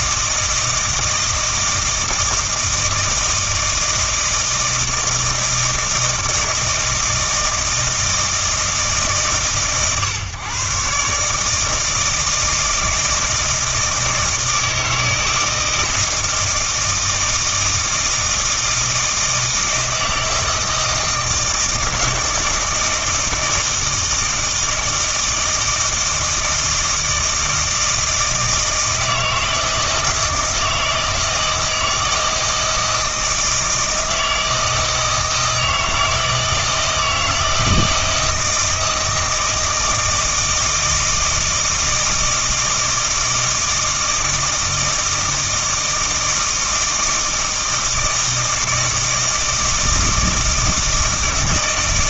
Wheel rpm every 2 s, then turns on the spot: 160, 160, 160, 160, 160, 130, 160, 160, 160, 160, 160, 160, 160, 160, 160, 160, 160, 160, 160, 170, 160, 160, 160, 160, 160, 160.
none